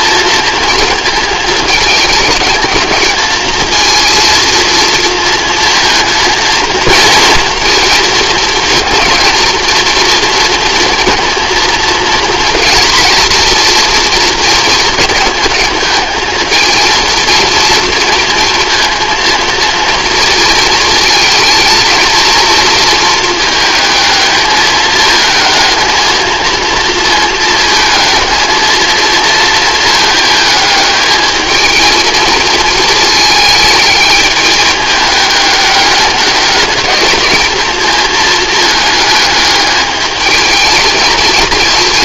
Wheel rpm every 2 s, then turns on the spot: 230, 220, 230, 230, 230, 230, 240, 230, 230, 230, 230, 230, 210, 230, 220, 210, 220, 210, 210, 210, 220.
none